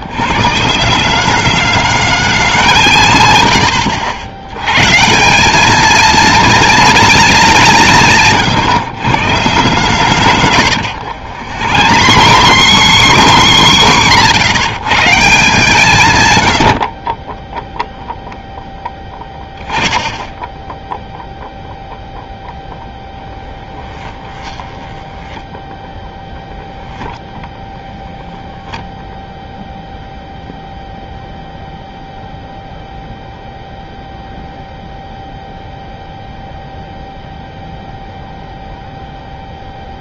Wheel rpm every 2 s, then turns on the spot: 150, 200, 100, 210, 140, 120, 140, 110, 100, 10, 10, 0, 20, 0, 0, 0, 0, 0, 0, 0.
10-14 24-26